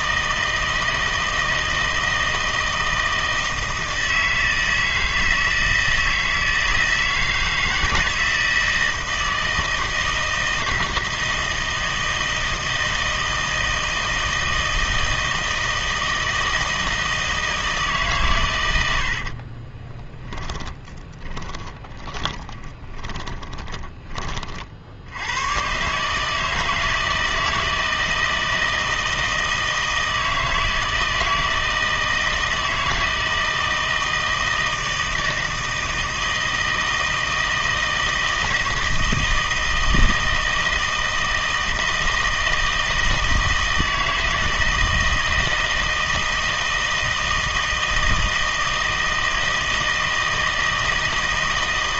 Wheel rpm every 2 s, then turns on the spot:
160, 160, 160, 160, 160, 160, 160, 160, 160, 100, 30, 20, 50, 160, 160, 160, 160, 160, 160, 160, 160, 160, 160, 160, 160, 160.
20-24